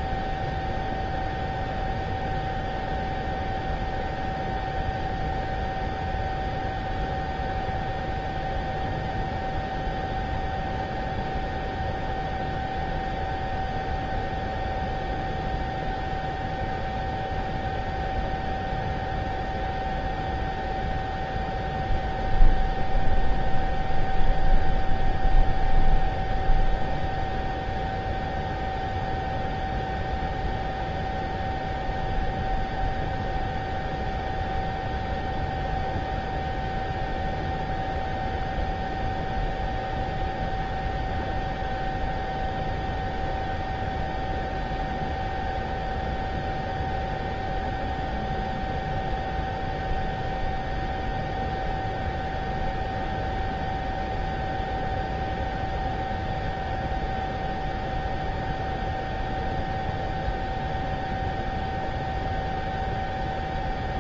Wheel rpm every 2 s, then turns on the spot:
0, 0, 0, 0, 0, 0, 0, 0, 0, 0, 0, 0, 0, 0, 0, 0, 0, 0, 0, 0, 0, 0, 0, 0, 0, 0, 0, 0, 0, 0, 0, 0.
none